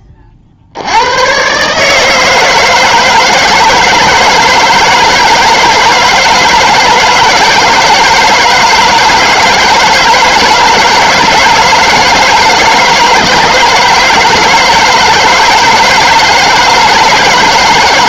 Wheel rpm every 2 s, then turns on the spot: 60, 160, 160, 160, 160, 160, 160, 160, 160.
none